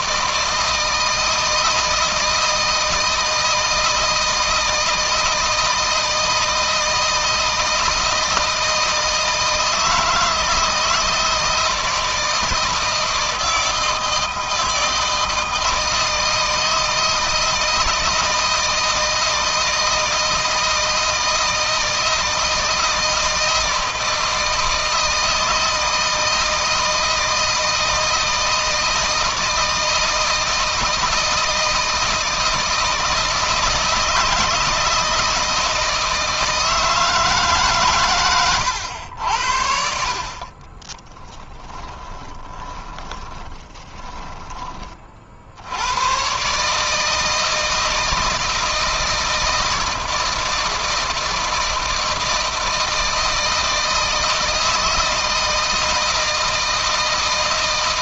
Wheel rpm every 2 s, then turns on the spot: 160, 160, 160, 160, 160, 160, 160, 160, 160, 160, 160, 160, 160, 160, 160, 160, 160, 160, 160, 100, 10, 30, 40, 160, 160, 160, 160, 160, 160.
40-44